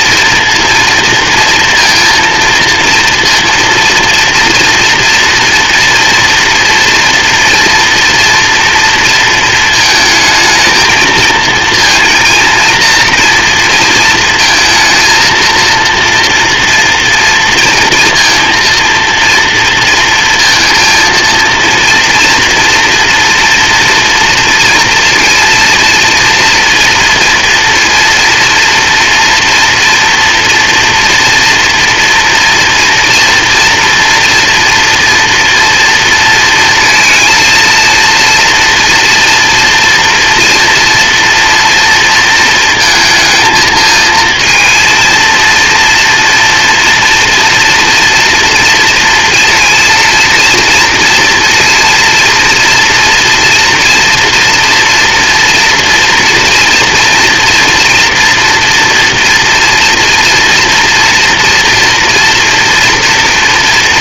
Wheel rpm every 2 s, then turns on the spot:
230, 230, 230, 240, 230, 220, 230, 230, 230, 230, 230, 230, 230, 240, 230, 230, 230, 230, 230, 240, 230, 220, 230, 230, 230, 230, 240, 230, 240, 230, 230, 230.
none